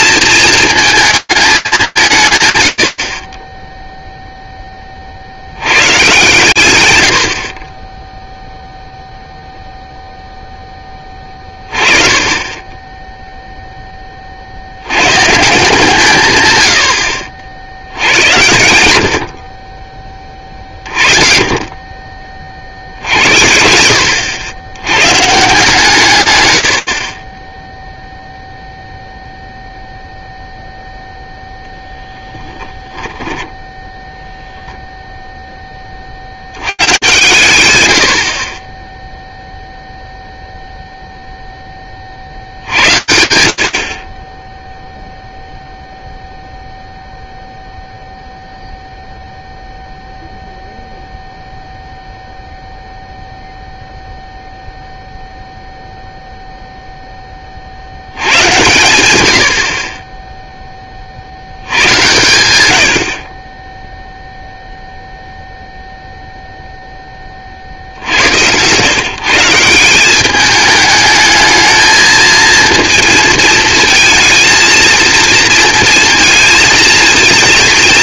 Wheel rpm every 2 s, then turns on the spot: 230, 140, 10, 130, 0, 20, 10, 130, 70, 60, 40, 80, 140, 30, 0, 0, 10, 0, 100, 0, 0, 70, 0, 0, 0, 0, 0, 0, 60, 40, 100, 0, 0, 60, 170, 220, 220, 230, 230.
18-20 26-28 32-34